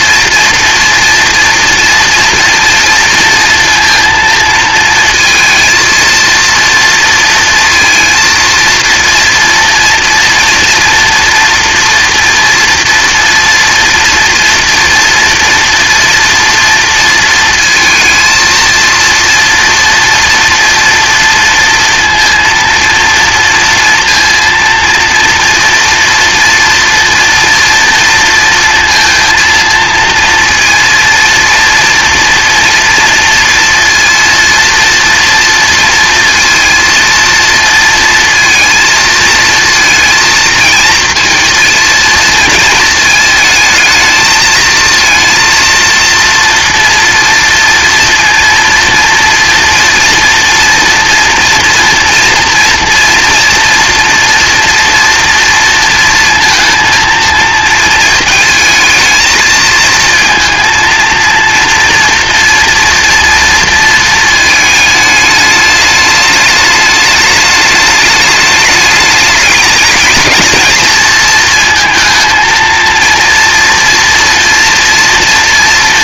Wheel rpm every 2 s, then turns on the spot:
230, 230, 230, 230, 230, 240, 240, 230, 230, 230, 230, 230, 230, 230, 230, 230, 230, 230, 230, 230, 230, 220, 230, 230, 230, 230, 230, 230, 230, 220, 230, 230, 210, 210, 210, 220, 230, 230.
none